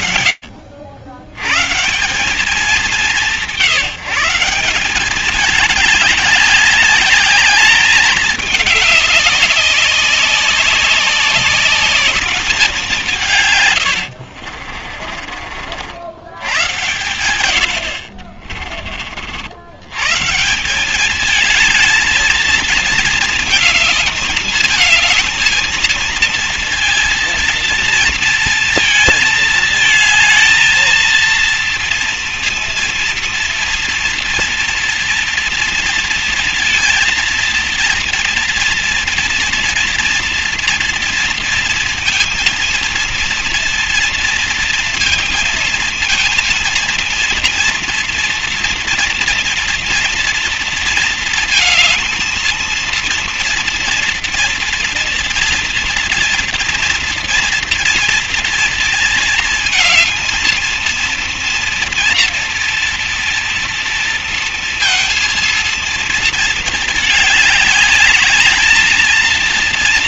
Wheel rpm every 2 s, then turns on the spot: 80, 180, 200, 200, 200, 200, 160, 40, 100, 40, 210, 220, 220, 230, 220, 230, 230, 230, 230, 230, 230, 230, 220, 230, 230, 230, 230, 240, 240, 230, 230, 240, 230, 210, 230.
12-16